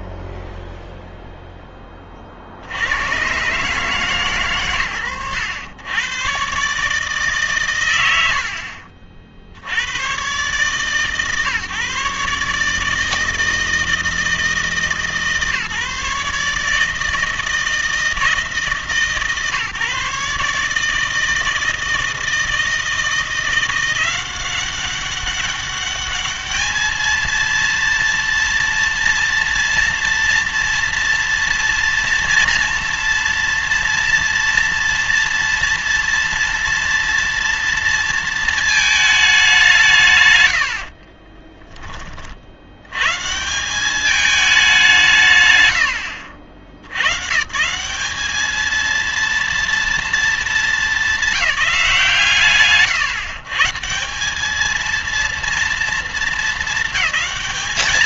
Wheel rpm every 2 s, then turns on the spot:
10, 60, 120, 140, 60, 140, 150, 160, 150, 150, 150, 160, 190, 220, 230, 230, 230, 240, 230, 220, 110, 90, 190, 80, 220, 210, 140, 220, 220.
0-2